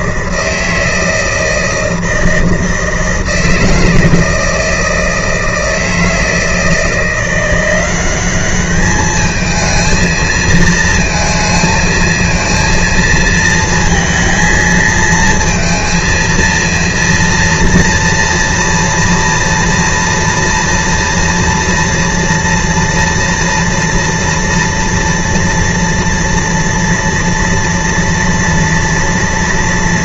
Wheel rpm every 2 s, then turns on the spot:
160, 160, 160, 160, 210, 230, 230, 230, 230, 230, 230, 230, 230, 230, 240.
none